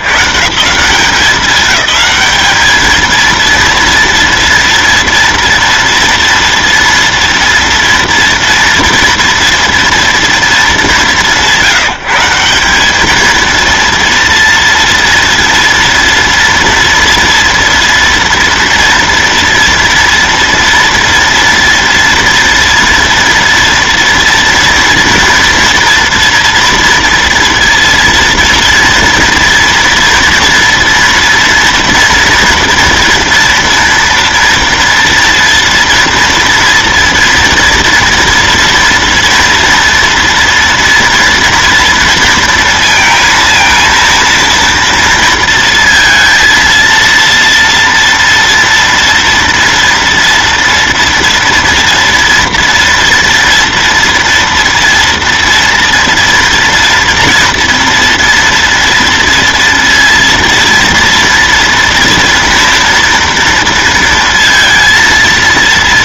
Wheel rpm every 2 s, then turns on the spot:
90, 210, 230, 230, 230, 230, 170, 230, 230, 230, 230, 230, 230, 230, 230, 240, 230, 230, 230, 240, 230, 230, 230, 230, 230, 230, 240, 230, 230, 230, 230, 230, 230.
none